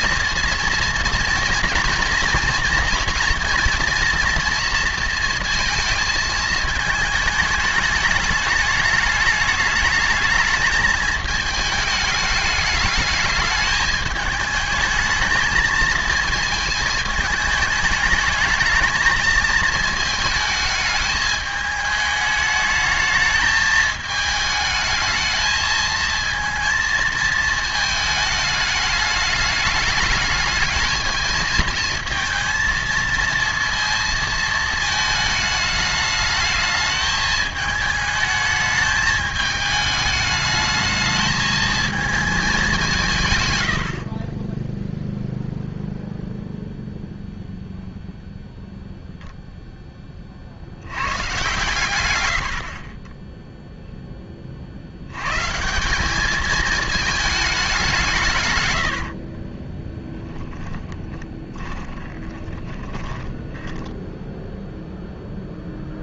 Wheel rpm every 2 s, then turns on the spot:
240, 240, 230, 220, 210, 220, 210, 220, 220, 220, 220, 220, 220, 230, 210, 220, 230, 220, 210, 210, 220, 160, 0, 0, 0, 100, 40, 70, 220, 90, 20, 20, 0.
58-64